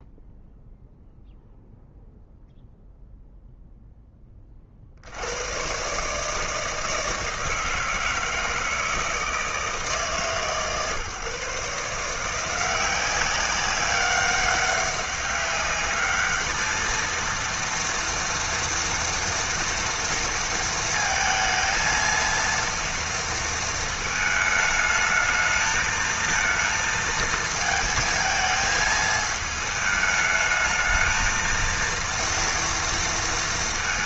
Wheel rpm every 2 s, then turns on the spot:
0, 0, 70, 160, 160, 150, 180, 200, 220, 230, 220, 230, 220, 220, 220, 220, 230.
none